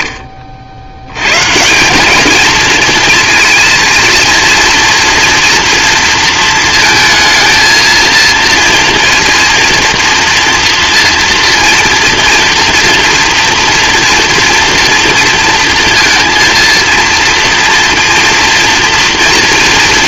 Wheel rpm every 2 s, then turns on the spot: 30, 220, 230, 230, 230, 230, 230, 230, 230, 240.
none